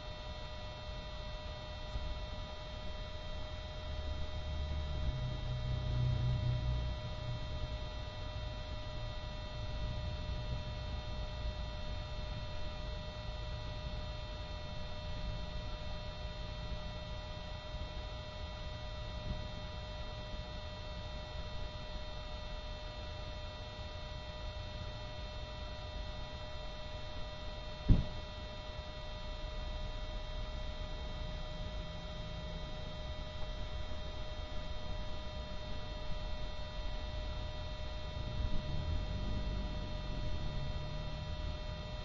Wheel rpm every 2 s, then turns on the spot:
0, 0, 0, 0, 0, 0, 0, 0, 0, 0, 0, 0, 0, 0, 0, 0, 0, 0, 0, 0, 0.
none